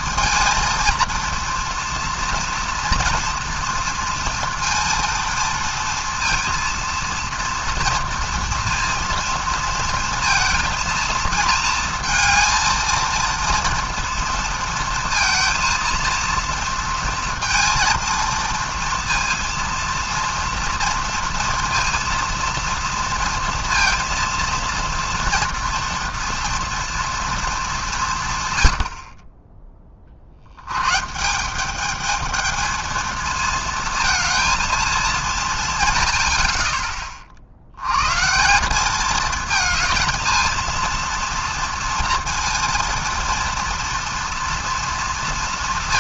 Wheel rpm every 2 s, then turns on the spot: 230, 240, 230, 230, 230, 230, 230, 230, 230, 230, 230, 230, 230, 230, 90, 110, 220, 220, 20, 190, 220, 230, 230.
36-38